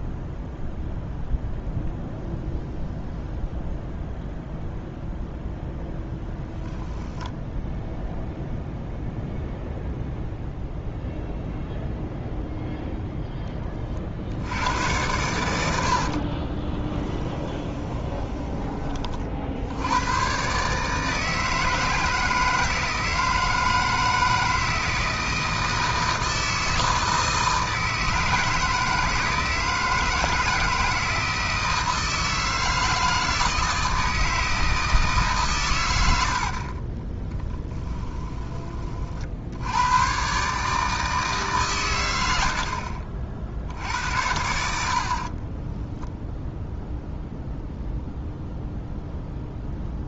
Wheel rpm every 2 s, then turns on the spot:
0, 0, 0, 0, 0, 0, 0, 100, 20, 30, 150, 160, 160, 160, 160, 160, 160, 160, 30, 40, 150, 50, 70, 0, 0.
16-18 36-38 42-44